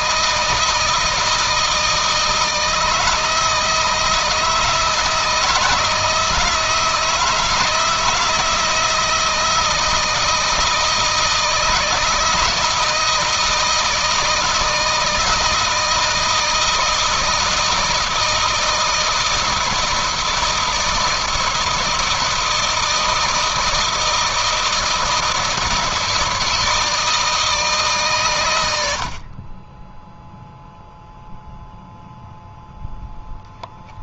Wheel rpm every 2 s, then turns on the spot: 160, 160, 160, 160, 170, 160, 170, 160, 160, 160, 160, 160, 160, 160, 80, 0, 0.
none